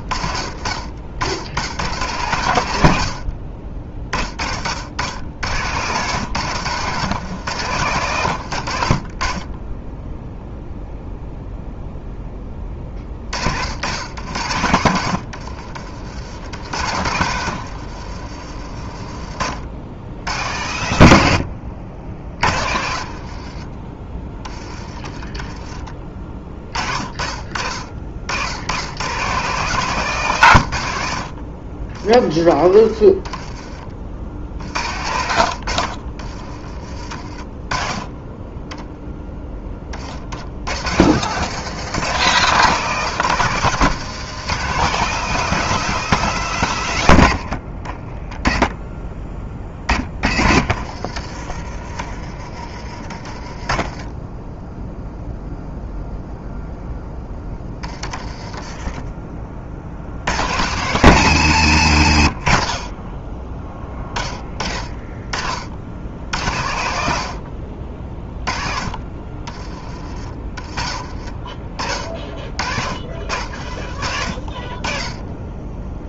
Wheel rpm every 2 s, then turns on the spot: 50, 90, 70, 130, 80, 0, 20, 80, 90, 40, 100, 60, 20, 40, 100, 100, 30, 70, 30, 10, 80, 150, 160, 160, 10, 40, 40, 10, 0, 20, 120, 50, 20, 90, 30, 30, 50, 30.
6-10 16-18 22-26 32-34 52-54